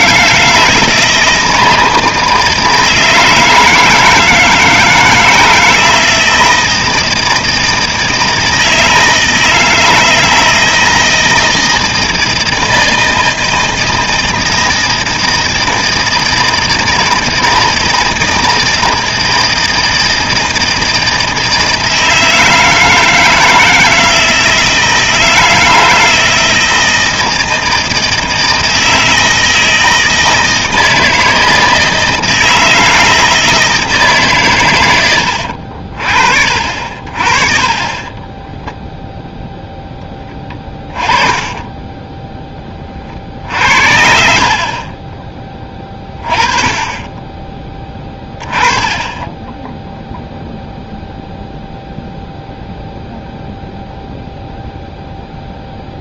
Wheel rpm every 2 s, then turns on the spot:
160, 160, 160, 160, 160, 160, 160, 160, 160, 160, 160, 160, 160, 160, 160, 160, 160, 120, 50, 10, 20, 10, 30, 20, 20, 0, 0, 0.
38-40 44-46